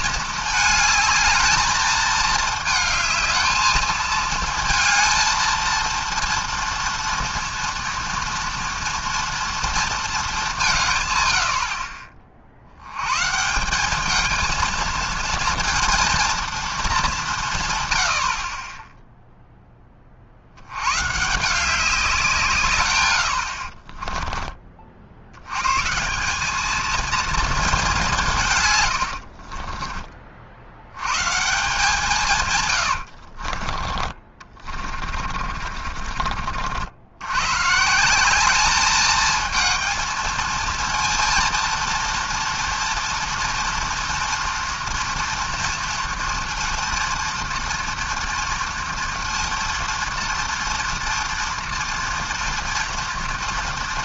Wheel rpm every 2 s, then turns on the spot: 220, 220, 220, 230, 230, 180, 70, 220, 220, 40, 80, 140, 30, 210, 130, 60, 130, 30, 50, 200, 220, 230, 230, 230, 230, 230, 230.
32-36